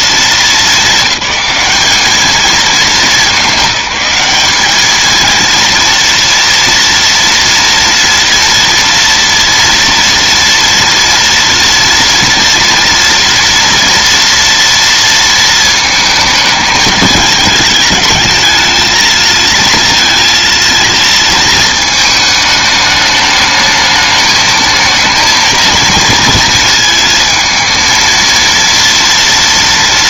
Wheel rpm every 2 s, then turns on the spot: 210, 200, 220, 230, 230, 230, 230, 230, 220, 220, 230, 210, 220, 230, 230.
none